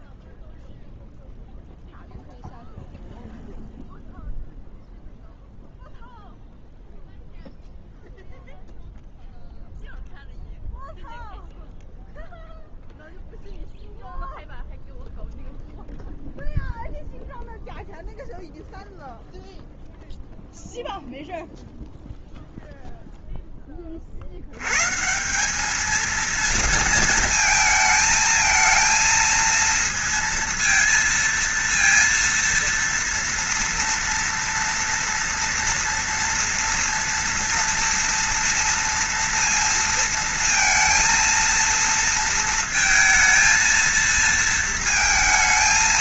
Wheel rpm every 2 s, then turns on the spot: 0, 0, 0, 0, 0, 0, 0, 0, 0, 0, 0, 0, 100, 230, 230, 230, 230, 230, 230, 240, 230, 230, 230.
none